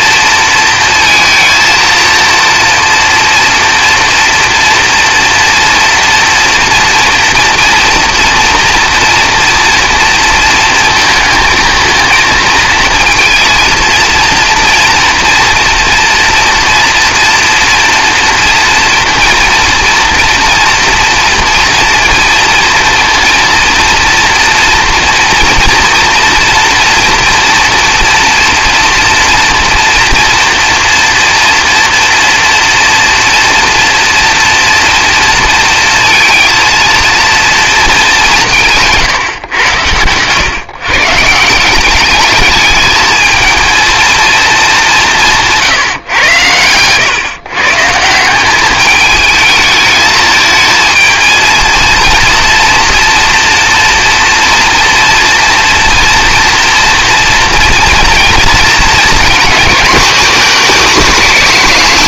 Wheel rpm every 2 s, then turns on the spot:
230, 230, 230, 230, 230, 230, 230, 230, 230, 230, 230, 230, 240, 230, 230, 230, 230, 230, 230, 170, 130, 210, 210, 110, 200, 220, 230, 230, 230, 230, 240.
none